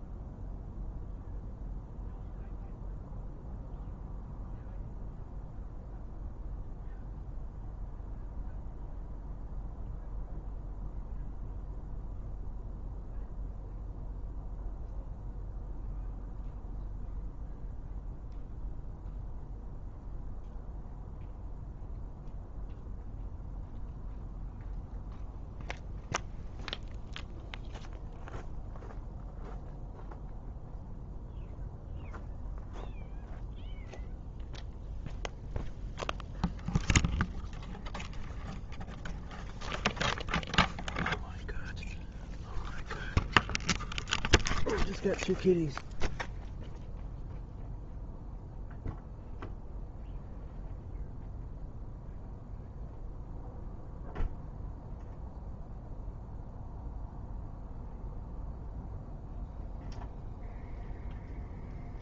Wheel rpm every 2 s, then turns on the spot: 0, 0, 0, 0, 0, 0, 0, 0, 0, 0, 0, 0, 0, 0, 0, 0, 0, 0, 0, 0, 0, 0, 0, 0, 0, 0, 0, 0, 0, 0, 0.
none